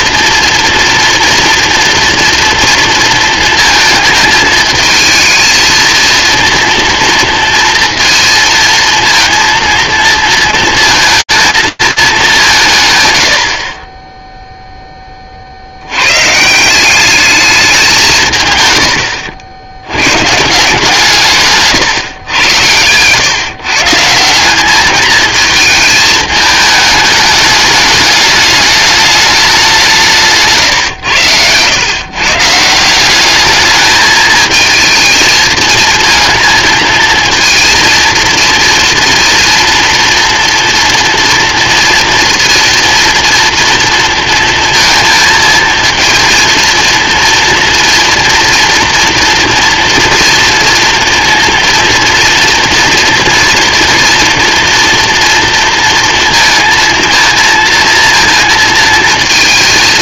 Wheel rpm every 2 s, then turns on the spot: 230, 230, 220, 230, 230, 230, 170, 0, 170, 110, 160, 110, 200, 210, 210, 120, 170, 220, 230, 230, 230, 230, 230, 230, 230, 230, 230, 230, 230, 230.
none